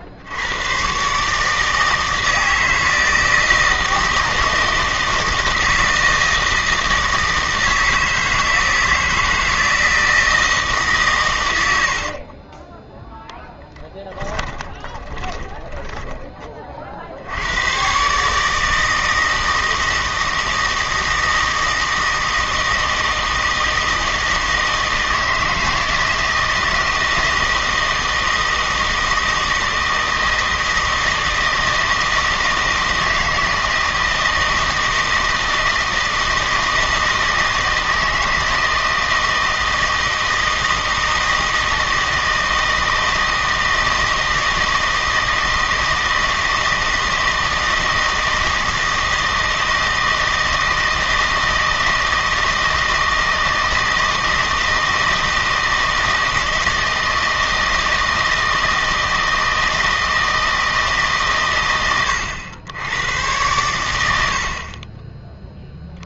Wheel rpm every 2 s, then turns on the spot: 110, 160, 160, 160, 160, 150, 10, 20, 50, 160, 160, 160, 160, 160, 160, 160, 160, 160, 160, 160, 160, 160, 160, 160, 160, 160, 160, 160, 160, 160, 160, 100, 30.
12-16